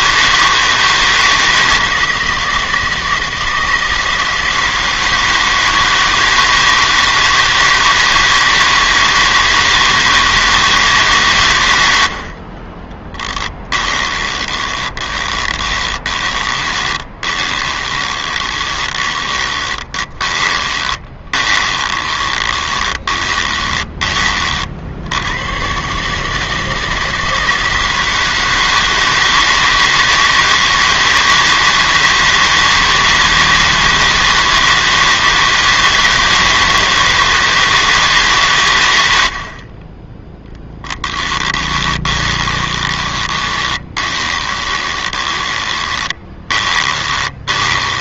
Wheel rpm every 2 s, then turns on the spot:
160, 160, 160, 160, 160, 160, 40, 20, 40, 20, 20, 20, 50, 160, 160, 160, 160, 160, 160, 130, 10, 20, 20, 30.
14-24 40-48